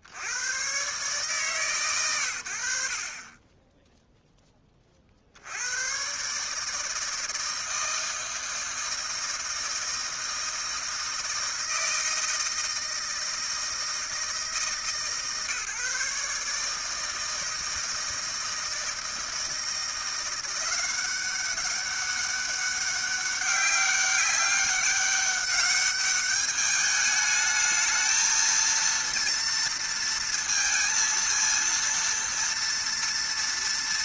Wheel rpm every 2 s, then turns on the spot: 30, 100, 10, 130, 160, 160, 160, 160, 150, 160, 180, 200, 200, 210, 230, 230, 230.
none